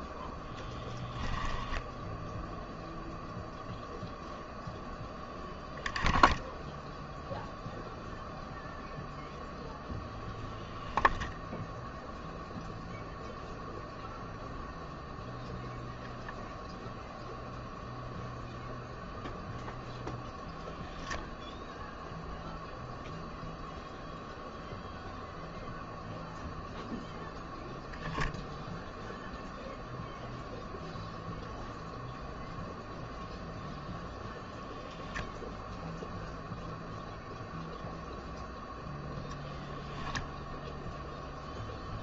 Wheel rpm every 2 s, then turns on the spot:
10, 0, 0, 0, 0, 0, 0, 0, 0, 0, 0, 0, 0, 0, 0, 0, 0, 0, 0, 0, 0.
none